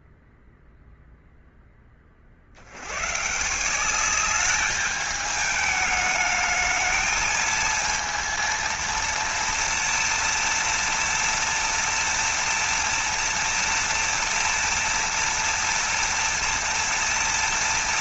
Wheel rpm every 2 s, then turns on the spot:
0, 80, 210, 220, 230, 230, 230, 230, 230.
none